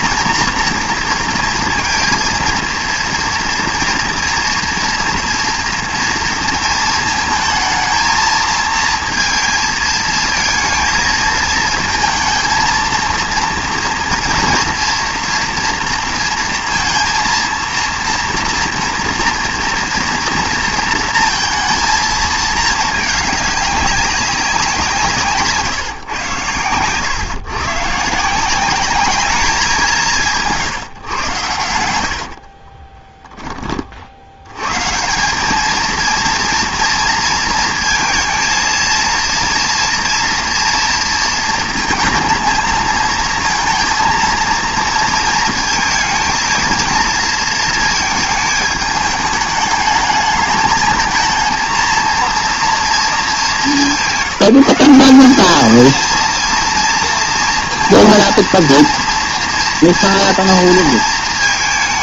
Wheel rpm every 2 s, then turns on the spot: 230, 230, 240, 230, 220, 220, 230, 230, 230, 230, 230, 220, 190, 110, 180, 130, 50, 120, 230, 230, 230, 230, 230, 230, 220, 220, 230, 190, 230, 230, 230.
32-34